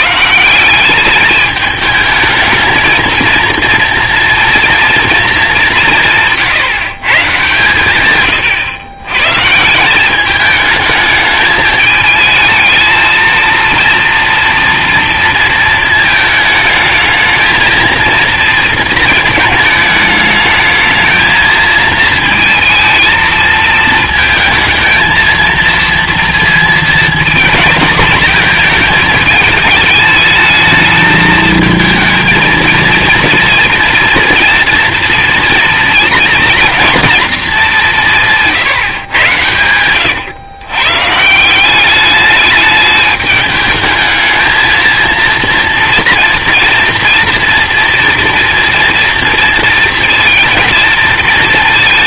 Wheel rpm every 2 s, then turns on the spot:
170, 220, 230, 150, 120, 210, 220, 230, 220, 230, 220, 220, 220, 230, 230, 220, 230, 230, 240, 160, 120, 210, 220, 230, 230, 230.
8-10